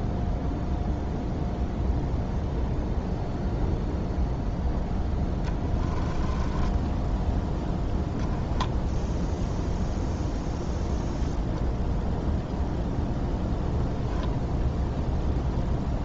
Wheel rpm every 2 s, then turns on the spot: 0, 0, 10, 10, 0, 0, 0, 0.
4-8